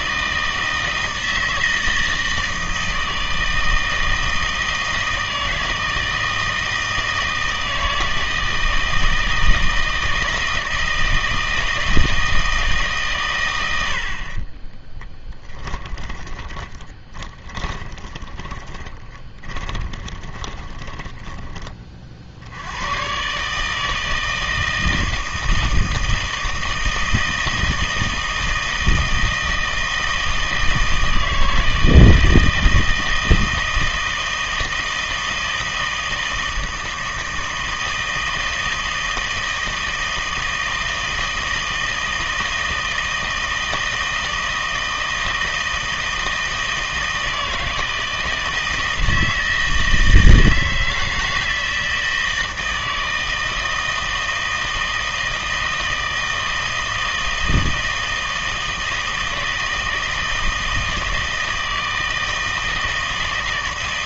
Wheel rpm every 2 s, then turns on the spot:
160, 160, 160, 160, 160, 160, 160, 10, 30, 20, 20, 90, 160, 160, 160, 160, 160, 160, 160, 160, 160, 160, 160, 160, 160, 160, 160, 160, 160, 160, 160, 160.
14-22